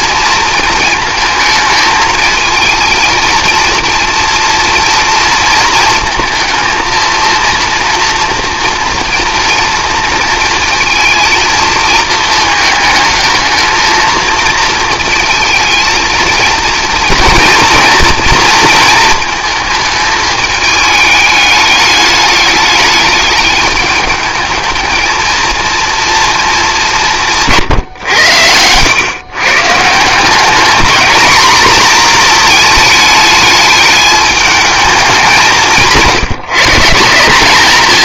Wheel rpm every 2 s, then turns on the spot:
230, 220, 230, 230, 230, 230, 220, 230, 230, 230, 210, 210, 220, 190, 110, 210, 220, 210, 170.
none